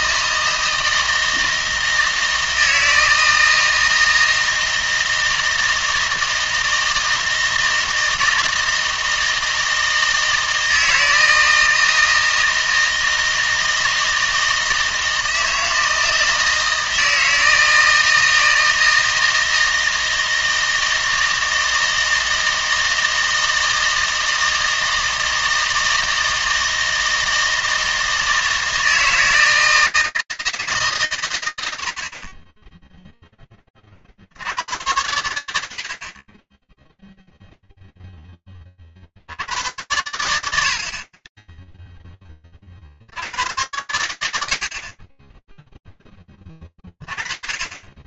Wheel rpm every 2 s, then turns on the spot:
160, 160, 160, 160, 160, 160, 160, 160, 160, 160, 160, 160, 160, 160, 160, 160, 20, 90, 10, 40, 70, 70, 40, 30.
none